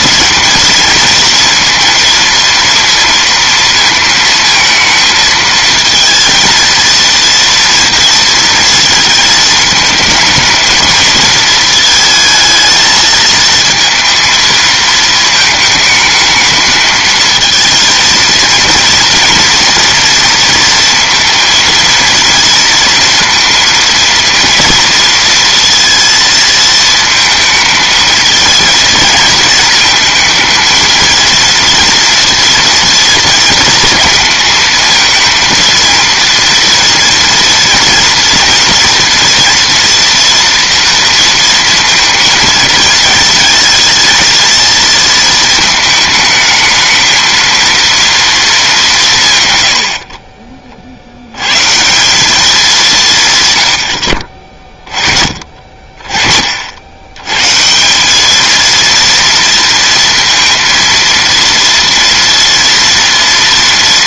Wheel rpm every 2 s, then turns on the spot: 230, 230, 230, 230, 230, 230, 220, 230, 220, 230, 230, 230, 230, 220, 220, 230, 230, 230, 230, 230, 230, 220, 230, 220, 200, 50, 190, 30, 70, 230, 230, 230.
none